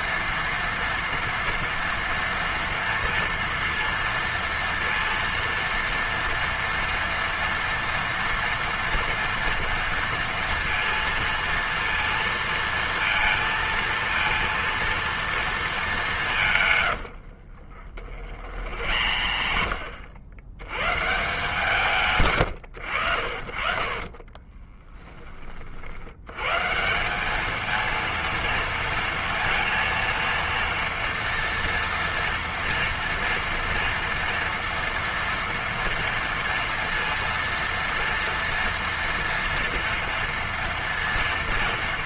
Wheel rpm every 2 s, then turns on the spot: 240, 230, 230, 230, 230, 230, 230, 230, 140, 70, 120, 110, 30, 140, 230, 230, 240, 230, 230, 230, 230.
16-20 24-26